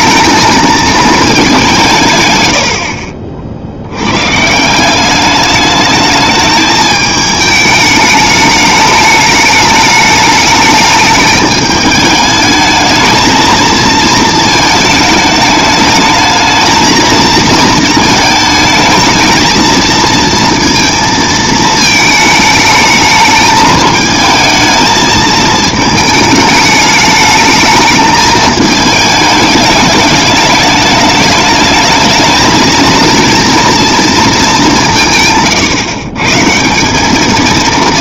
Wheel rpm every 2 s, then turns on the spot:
220, 90, 160, 220, 210, 210, 220, 220, 220, 220, 230, 220, 220, 210, 220, 210, 230, 190, 180.
none